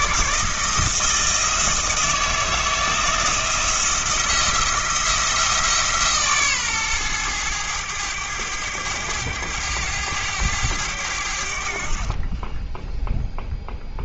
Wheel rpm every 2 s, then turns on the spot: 160, 170, 170, 120, 100, 100, 10.
none